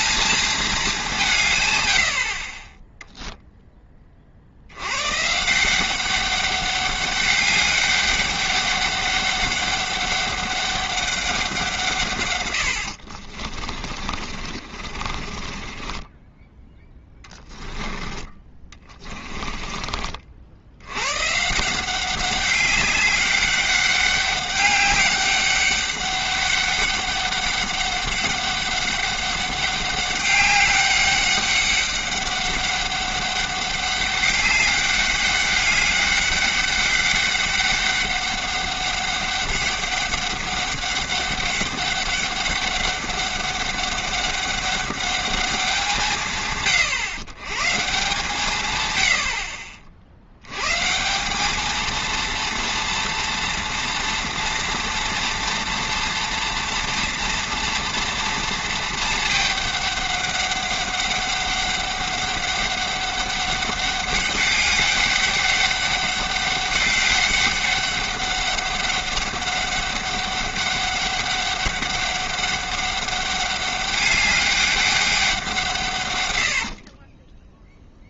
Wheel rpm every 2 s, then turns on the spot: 210, 20, 80, 200, 200, 200, 90, 40, 10, 20, 80, 200, 200, 200, 200, 200, 200, 200, 200, 200, 200, 200, 200, 130, 130, 140, 230, 230, 230, 230, 200, 200, 200, 200, 200, 200, 200, 200, 60.
14-20 76-78